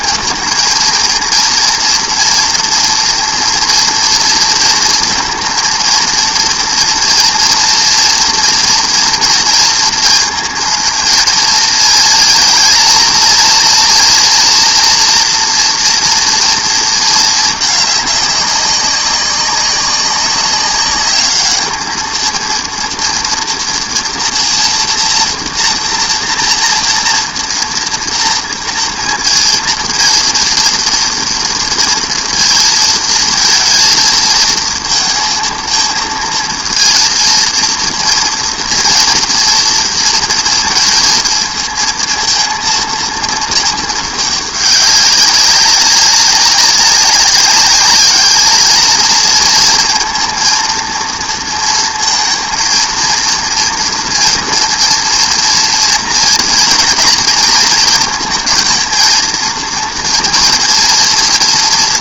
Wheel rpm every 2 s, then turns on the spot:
230, 230, 230, 230, 230, 230, 230, 240, 230, 200, 200, 230, 240, 230, 230, 230, 230, 220, 230, 230, 230, 230, 200, 200, 220, 230, 230, 230, 240, 230, 230.
none